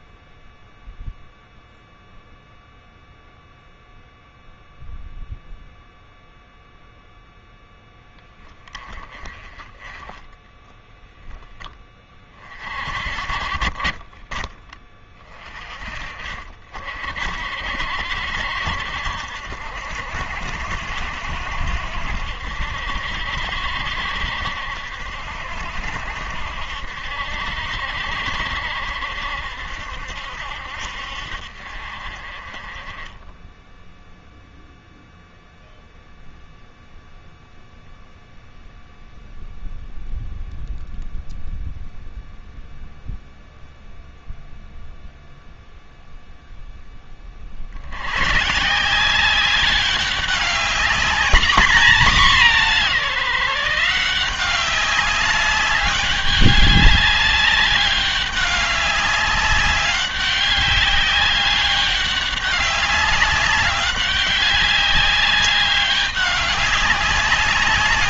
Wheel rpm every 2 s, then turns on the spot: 0, 0, 0, 0, 20, 10, 40, 20, 50, 60, 70, 70, 70, 70, 70, 60, 20, 0, 0, 0, 0, 0, 0, 10, 180, 210, 180, 200, 200, 200, 200, 200, 200, 190.
none